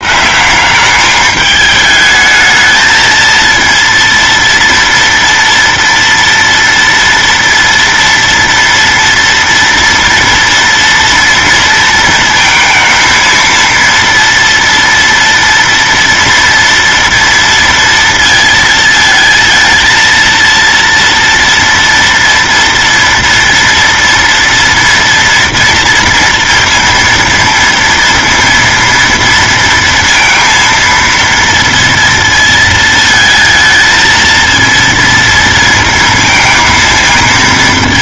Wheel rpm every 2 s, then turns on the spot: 180, 220, 230, 230, 230, 230, 230, 230, 230, 230, 230, 230, 230, 230, 230, 230, 230, 230, 230.
none